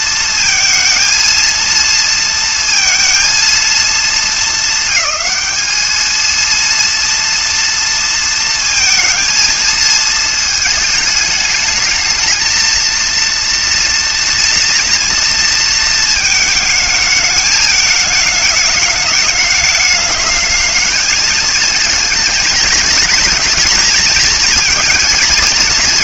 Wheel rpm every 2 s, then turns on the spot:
230, 230, 210, 230, 230, 220, 230, 240, 220, 210, 220, 220, 230.
none